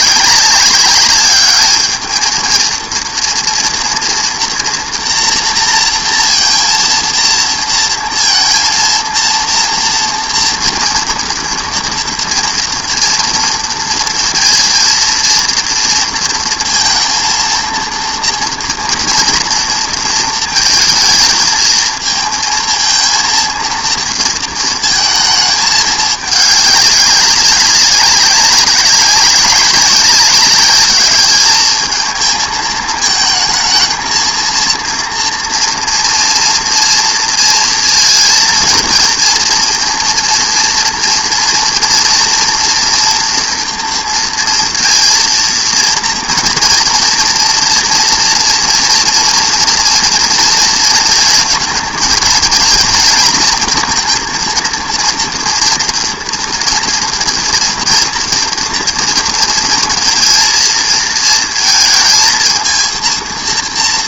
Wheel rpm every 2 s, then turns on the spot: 200, 230, 240, 230, 230, 240, 230, 230, 230, 230, 220, 230, 230, 210, 190, 210, 220, 230, 230, 230, 230, 230, 230, 230, 230, 230, 230, 230, 230, 230, 230, 230.
none